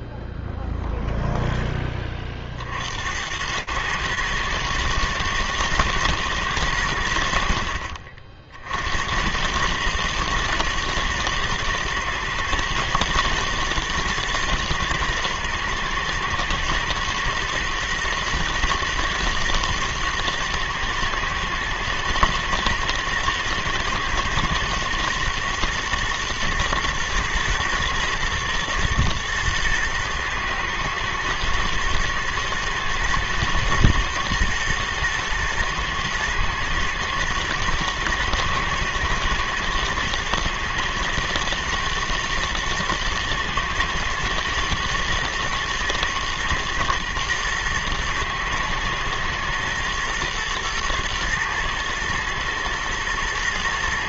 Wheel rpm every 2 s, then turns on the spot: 0, 70, 110, 90, 80, 120, 120, 120, 110, 120, 110, 120, 120, 120, 120, 110, 110, 110, 120, 120, 120, 120, 120, 110, 110, 110, 110.
none